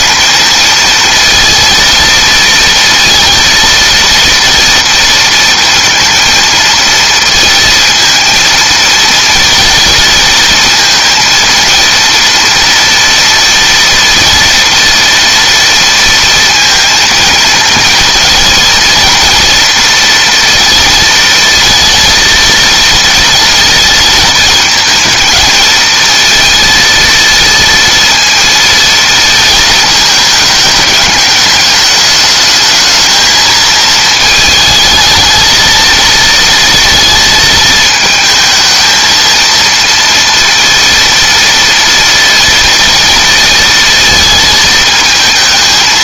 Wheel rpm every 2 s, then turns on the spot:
230, 230, 230, 230, 230, 230, 230, 230, 230, 230, 230, 230, 220, 230, 230, 210, 220, 220, 230, 220, 230, 230, 220.
none